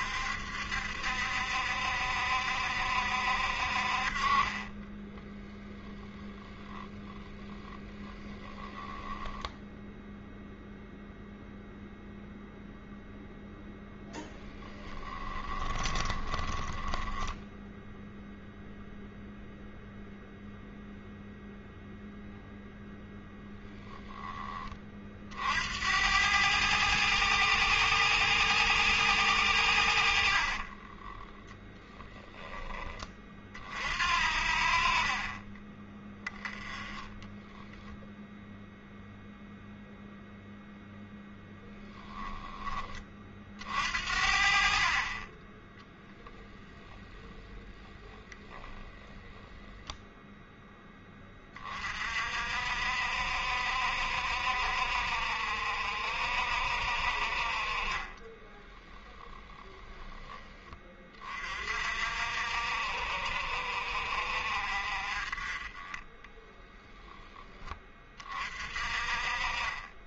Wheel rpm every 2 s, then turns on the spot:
70, 70, 20, 10, 10, 0, 0, 10, 20, 0, 0, 0, 30, 110, 110, 40, 20, 50, 10, 0, 0, 20, 40, 10, 10, 10, 60, 60, 60, 20, 30, 60, 50, 10, 40.
4-10 14-18 30-32 36-38 44-46 58-60